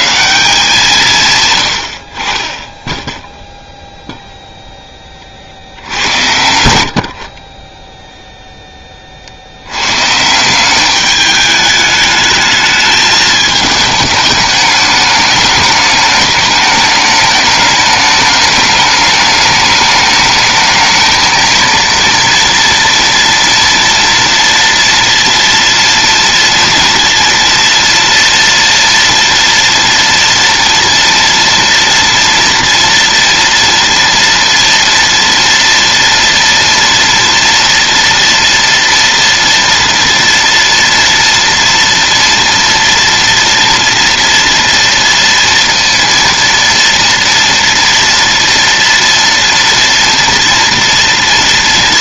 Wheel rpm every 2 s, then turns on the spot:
190, 20, 0, 100, 10, 180, 220, 210, 210, 210, 220, 230, 230, 230, 230, 230, 230, 230, 230, 240, 230, 230, 230, 230, 230, 230.
none